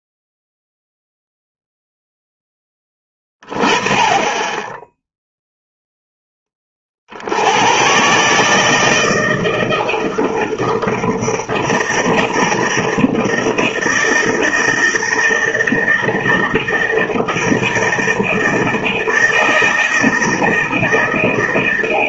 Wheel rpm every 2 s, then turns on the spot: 0, 10, 10, 30, 160, 160, 160, 160, 160, 160, 160.
none